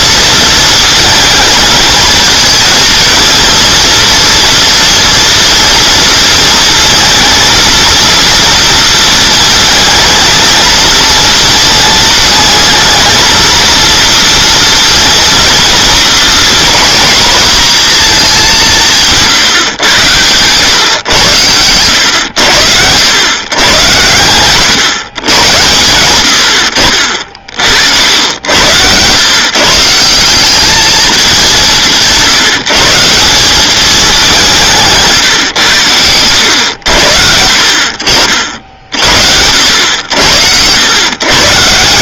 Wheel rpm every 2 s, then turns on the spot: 230, 220, 230, 220, 230, 220, 220, 230, 240, 180, 120, 90, 120, 70, 100, 200, 160, 190, 100, 60, 100.
none